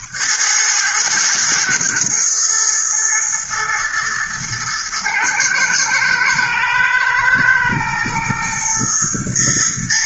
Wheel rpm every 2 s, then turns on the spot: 110, 120, 110, 110, 120.
none